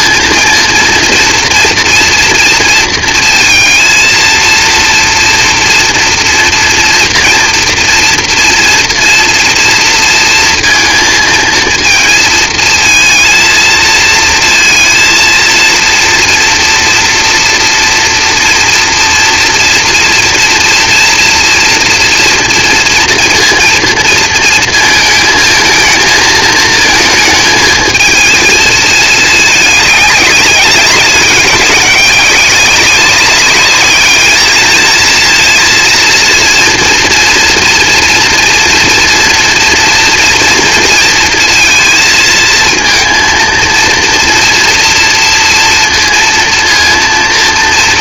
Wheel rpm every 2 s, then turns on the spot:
230, 230, 230, 230, 230, 230, 230, 230, 230, 230, 230, 230, 230, 220, 220, 200, 190, 230, 240, 230, 230, 230, 230, 230.
none